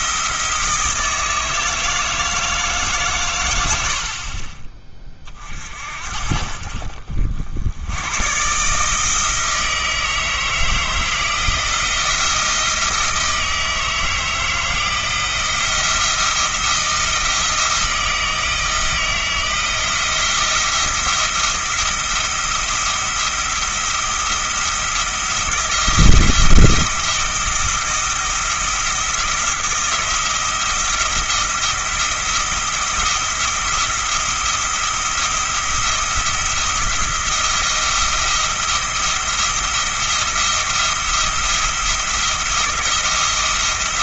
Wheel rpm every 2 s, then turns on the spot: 160, 150, 30, 60, 140, 160, 160, 160, 170, 160, 170, 170, 170, 170, 170, 170, 170, 170, 170, 170, 170, 170.
none